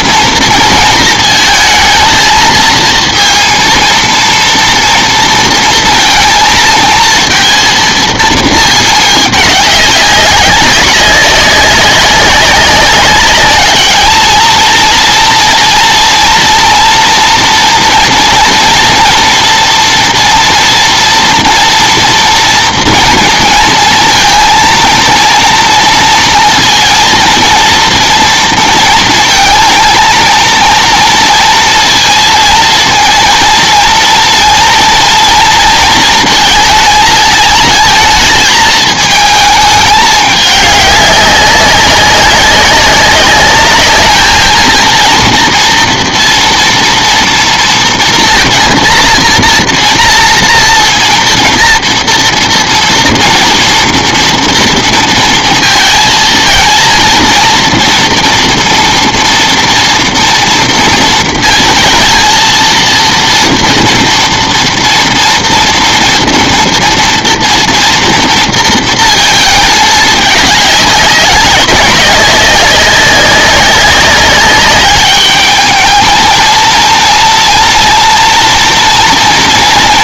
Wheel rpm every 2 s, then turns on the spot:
230, 220, 230, 230, 220, 200, 200, 230, 240, 230, 230, 230, 230, 230, 230, 230, 230, 230, 220, 220, 200, 190, 220, 240, 230, 230, 230, 230, 220, 230, 230, 230, 230, 230, 230, 200, 200, 200, 230, 230.
none